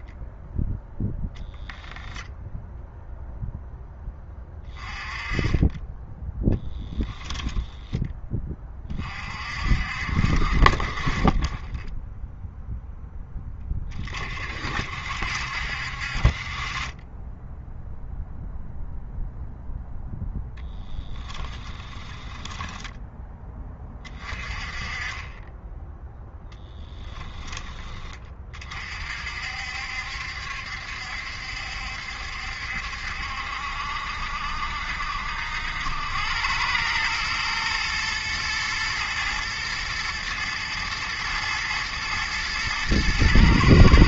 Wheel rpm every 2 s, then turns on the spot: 0, 0, 20, 10, 30, 40, 0, 60, 20, 0, 10, 10, 30, 10, 40, 70, 70, 70, 100, 110, 110, 110.
6-8 20-24 26-28